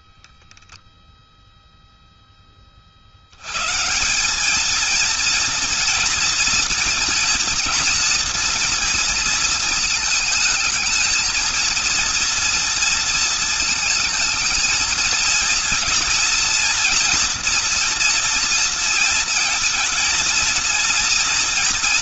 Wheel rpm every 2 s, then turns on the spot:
0, 140, 230, 230, 230, 230, 220, 230, 240, 230, 240.
none